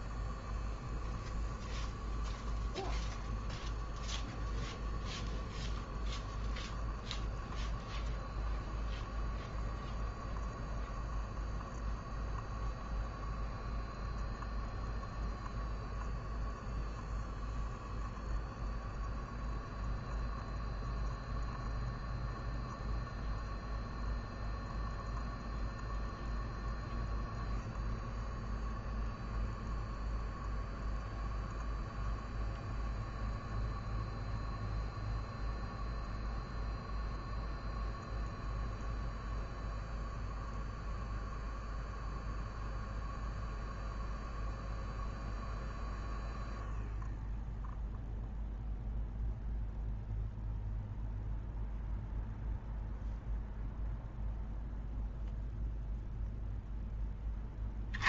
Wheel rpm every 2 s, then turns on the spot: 0, 0, 0, 0, 0, 0, 0, 0, 0, 0, 0, 0, 0, 0, 0, 0, 0, 0, 0, 0, 0, 0, 0, 0, 0, 0, 0, 0, 0.
none